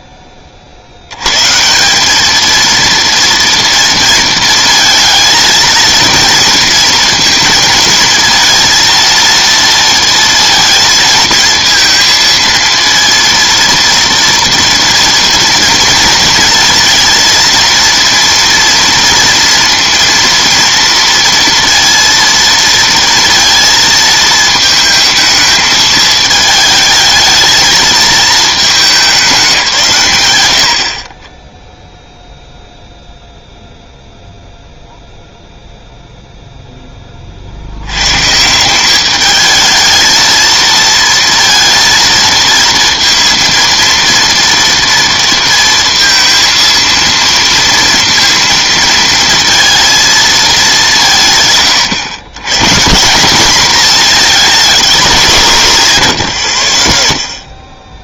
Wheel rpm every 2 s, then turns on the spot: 20, 210, 230, 230, 230, 230, 230, 230, 230, 230, 230, 230, 220, 220, 220, 120, 0, 0, 10, 190, 230, 230, 230, 230, 230, 180, 150, 210, 30.
none